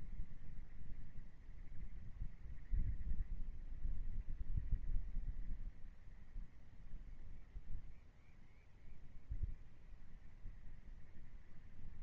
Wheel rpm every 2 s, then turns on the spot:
0, 0, 0, 0, 0, 0.
none